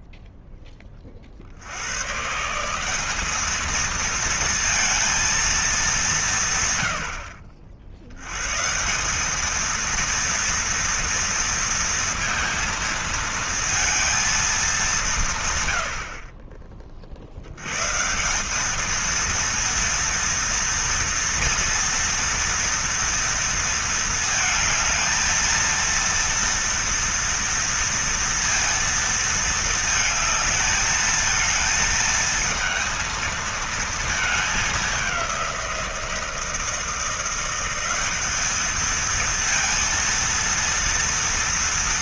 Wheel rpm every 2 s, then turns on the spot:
30, 190, 230, 100, 170, 230, 230, 200, 30, 210, 230, 230, 220, 230, 230, 220, 220, 200, 170, 220, 230.
none